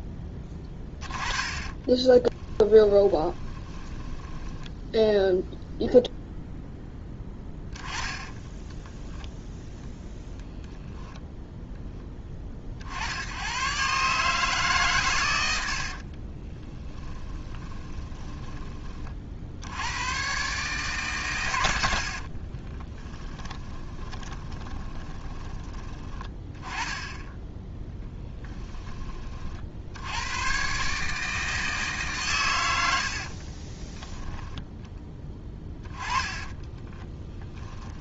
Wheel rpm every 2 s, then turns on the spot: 20, 20, 10, 0, 10, 0, 50, 130, 20, 20, 140, 20, 20, 10, 10, 130, 110, 10, 20.
2-4 8-10 16-18 22-26 36-38